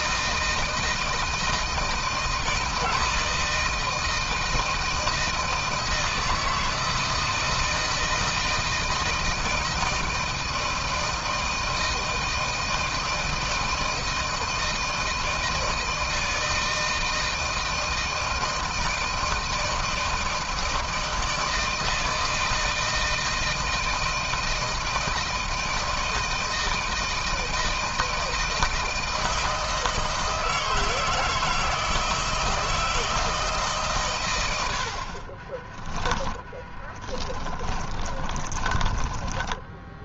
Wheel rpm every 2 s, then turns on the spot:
160, 160, 160, 160, 160, 160, 160, 160, 160, 160, 160, 160, 160, 160, 170, 160, 160, 110, 10, 20.
36-40